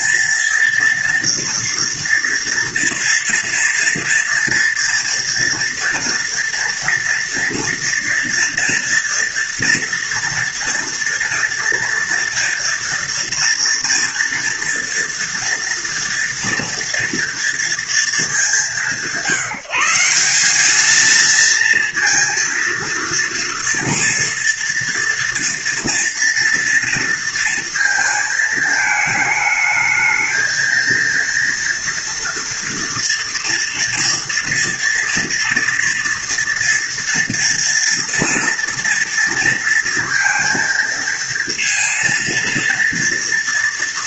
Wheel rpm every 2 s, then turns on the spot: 240, 230, 230, 240, 230, 230, 230, 230, 230, 190, 210, 230, 230, 230, 220, 230, 230, 230, 230, 230, 230, 230.
none